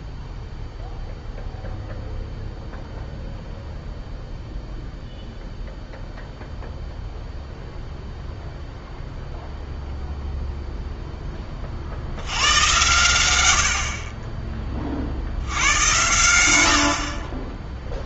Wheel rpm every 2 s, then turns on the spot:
0, 0, 0, 0, 0, 0, 100, 30, 70.
none